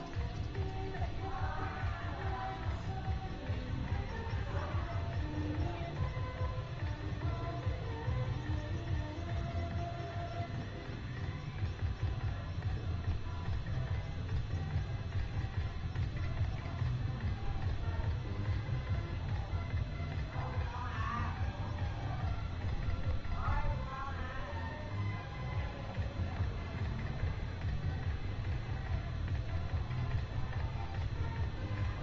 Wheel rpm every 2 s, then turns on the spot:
0, 0, 0, 0, 0, 0, 0, 0, 0, 0, 0, 0, 0, 0, 0, 0.
none